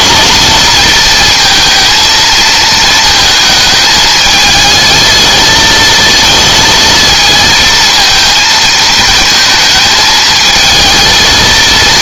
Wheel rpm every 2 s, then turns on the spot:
220, 220, 220, 230, 220, 220.
none